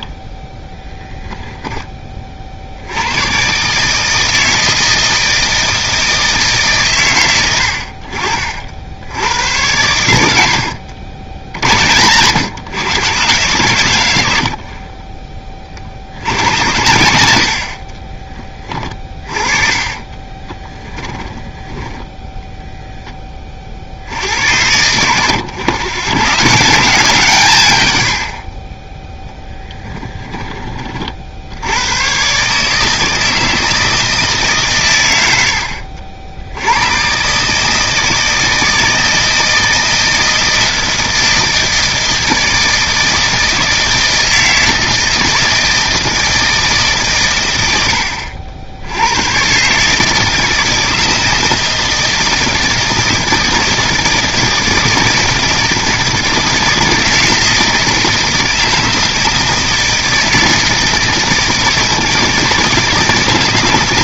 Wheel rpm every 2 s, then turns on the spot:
10, 80, 160, 140, 60, 80, 120, 40, 90, 20, 10, 10, 90, 150, 20, 20, 150, 120, 100, 160, 170, 160, 160, 150, 80, 160, 160, 160, 160, 160, 160, 160.
20-22 28-30